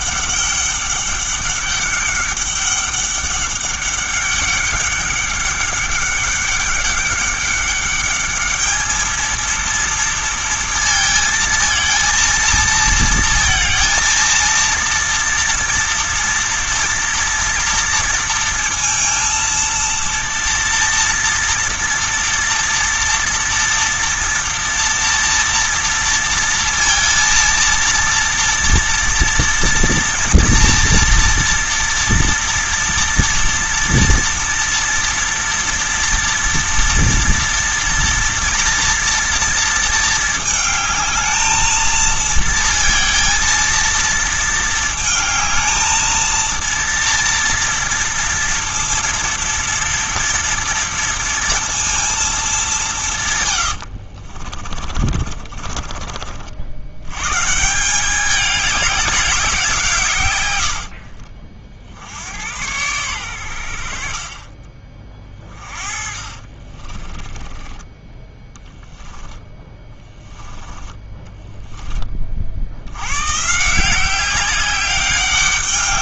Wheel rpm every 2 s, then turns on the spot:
200, 200, 200, 200, 210, 230, 230, 230, 230, 230, 230, 230, 230, 230, 230, 240, 230, 230, 240, 240, 220, 230, 220, 230, 230, 230, 200, 40, 80, 200, 80, 100, 30, 30, 10, 20, 80, 190.
54-56 60-62 64-70